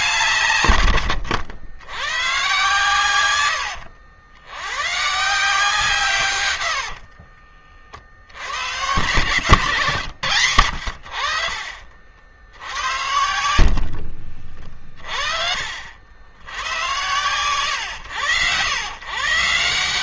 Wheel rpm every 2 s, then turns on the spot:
110, 120, 140, 50, 120, 60, 80, 30, 120, 130.
0-2 6-8 12-14